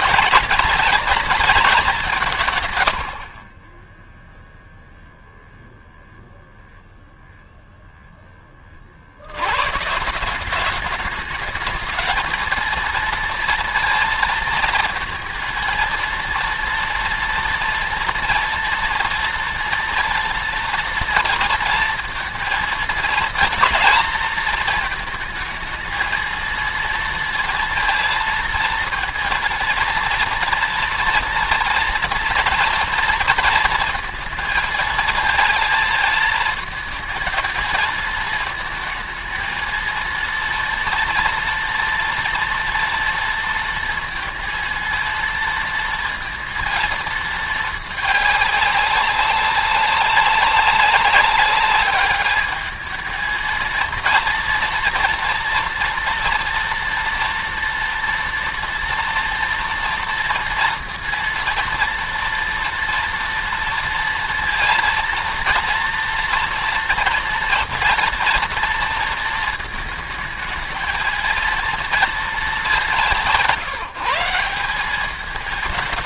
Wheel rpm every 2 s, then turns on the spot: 230, 120, 0, 0, 50, 200, 230, 230, 230, 230, 230, 230, 220, 230, 230, 230, 230, 230, 220, 220, 230, 230, 220, 220, 210, 200, 210, 230, 230, 230, 230, 230, 230, 230, 230, 220, 190, 200.
none